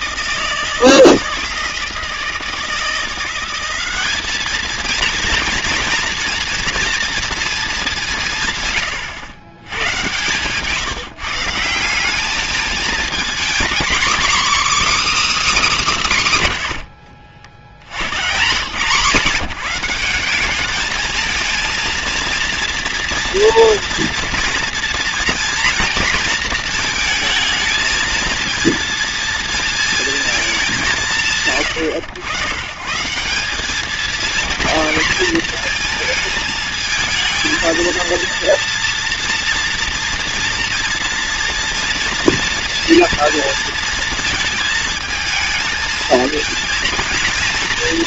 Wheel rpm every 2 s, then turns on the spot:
160, 170, 220, 240, 130, 160, 220, 310, 110, 130, 210, 240, 230, 230, 230, 180, 130, 230, 220, 230, 230, 230, 220, 230.
16-18